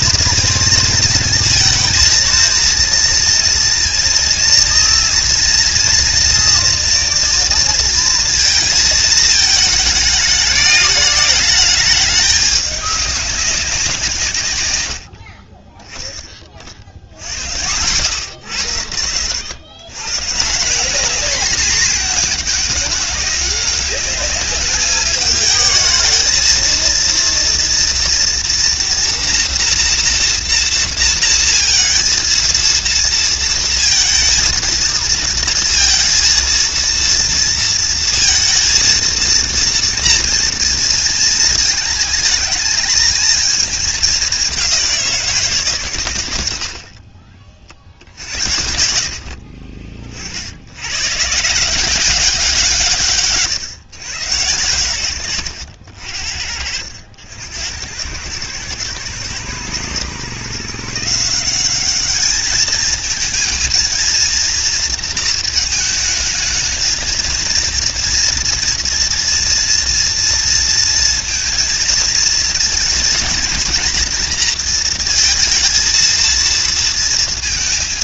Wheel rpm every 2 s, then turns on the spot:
230, 230, 230, 230, 230, 210, 210, 130, 30, 80, 180, 210, 210, 220, 230, 230, 230, 230, 230, 230, 230, 220, 200, 70, 60, 80, 180, 120, 60, 110, 140, 210, 230, 220, 230, 230, 230, 230, 230.
none